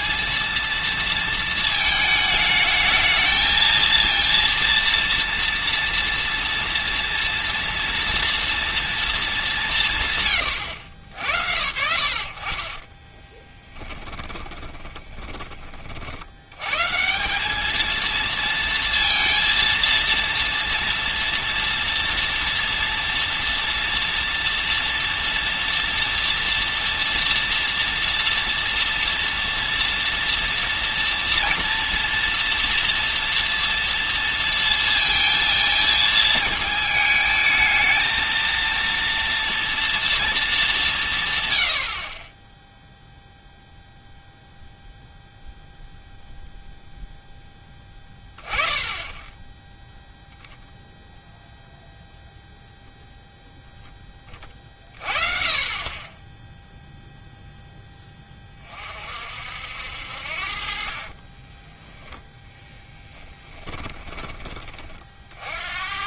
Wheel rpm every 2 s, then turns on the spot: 230, 220, 230, 230, 230, 100, 40, 30, 120, 230, 230, 230, 230, 230, 230, 230, 230, 230, 220, 230, 180, 0, 0, 0, 10, 0, 0, 40, 0, 40, 40, 10, 30.
12-16 62-64